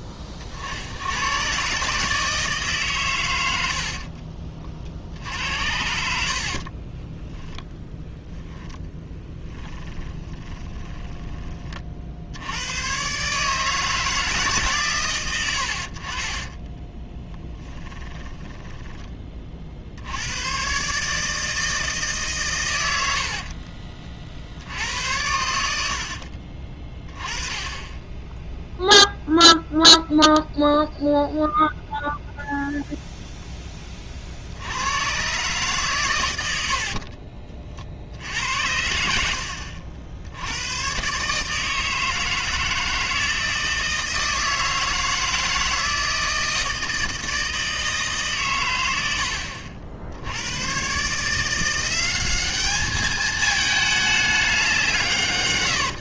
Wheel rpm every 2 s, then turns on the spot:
40, 150, 40, 40, 10, 20, 90, 140, 20, 20, 120, 120, 60, 40, 0, 0, 0, 80, 80, 80, 100, 160, 160, 160, 110, 100, 200, 190.
6-12 16-20 36-38